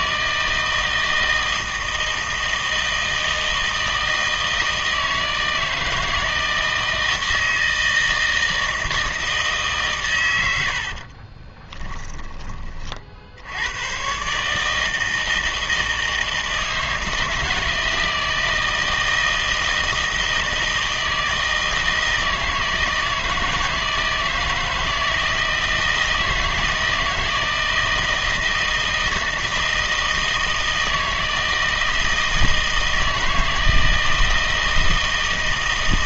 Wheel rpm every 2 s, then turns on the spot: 160, 160, 160, 160, 160, 70, 30, 160, 160, 160, 160, 160, 160, 160, 160, 160, 160, 160.
10-12